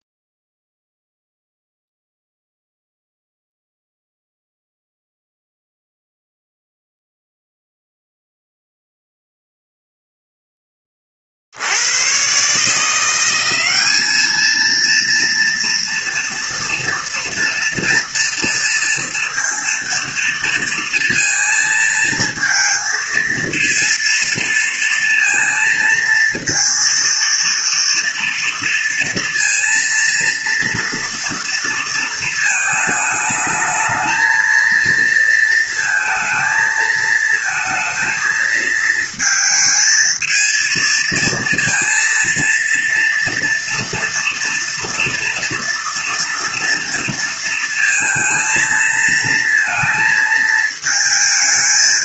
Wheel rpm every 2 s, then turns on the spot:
0, 0, 0, 0, 0, 20, 150, 220, 240, 230, 230, 230, 230, 230, 230, 230, 220, 230, 220, 220, 220, 230, 230, 230, 230, 220.
none